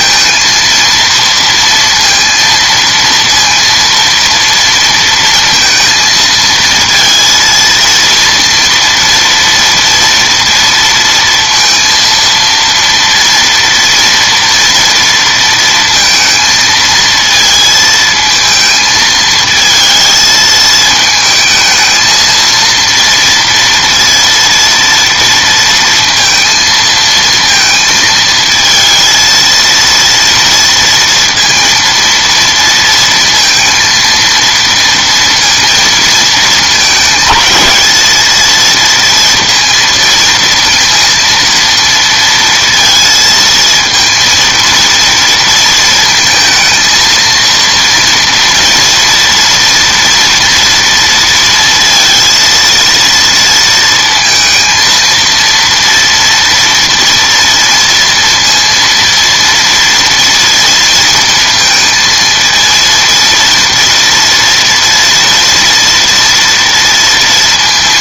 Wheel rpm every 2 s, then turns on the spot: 230, 230, 230, 230, 230, 230, 230, 230, 230, 220, 220, 230, 230, 230, 230, 230, 230, 230, 220, 220, 230, 230, 230, 230, 230, 230, 230, 230, 230, 230, 230, 230, 230, 230.
none